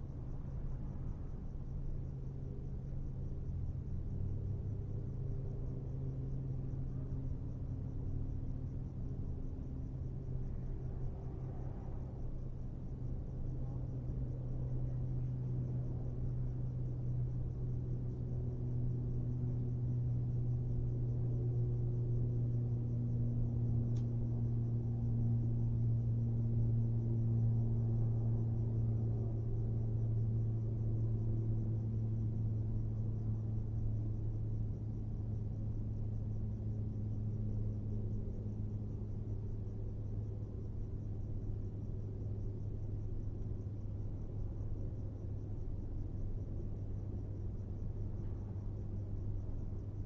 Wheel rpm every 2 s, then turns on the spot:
0, 0, 0, 0, 0, 0, 0, 0, 0, 0, 0, 0, 0, 0, 0, 0, 0, 0, 0, 0, 0, 0, 0, 0, 0.
none